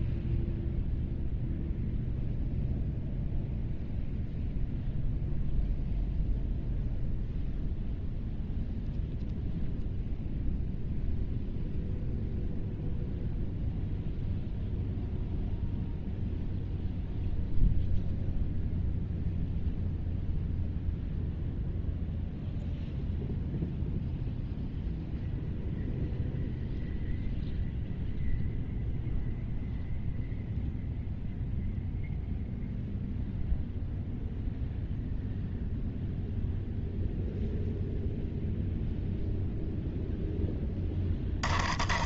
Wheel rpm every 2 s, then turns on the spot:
0, 0, 0, 0, 0, 0, 0, 0, 0, 0, 0, 0, 0, 0, 0, 0, 0, 0, 0, 0, 10.
none